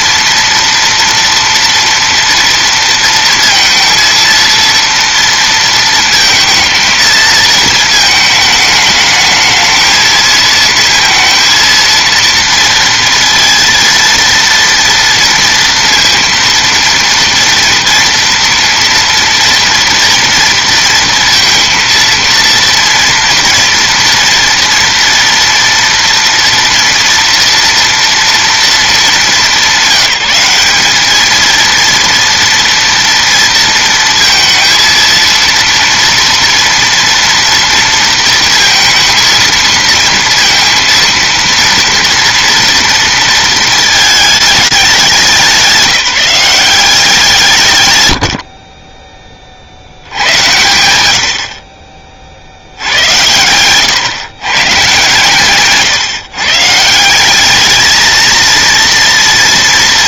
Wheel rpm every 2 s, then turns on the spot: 230, 230, 230, 230, 220, 220, 230, 230, 230, 230, 230, 230, 230, 230, 230, 190, 230, 230, 230, 220, 230, 230, 200, 180, 70, 100, 60, 130, 140, 230.
none